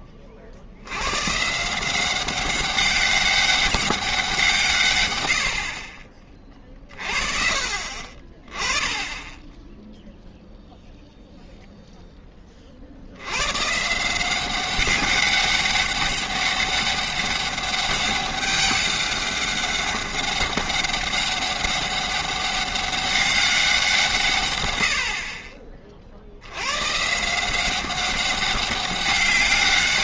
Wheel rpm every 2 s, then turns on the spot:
80, 190, 150, 30, 20, 0, 30, 190, 200, 200, 200, 200, 100, 110, 200.
none